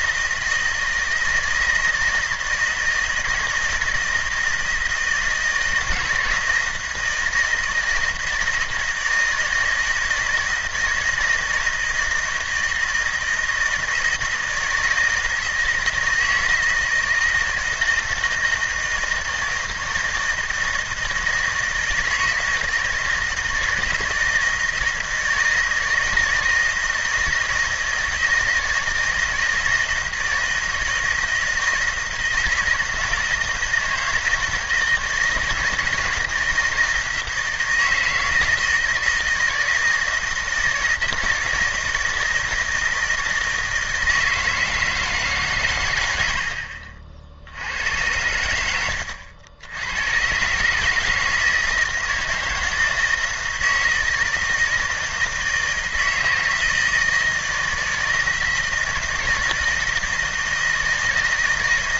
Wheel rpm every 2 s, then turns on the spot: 160, 160, 160, 160, 160, 160, 160, 160, 160, 160, 160, 160, 160, 160, 160, 160, 160, 160, 160, 160, 160, 160, 160, 60, 90, 140, 160, 160, 160, 160, 160.
none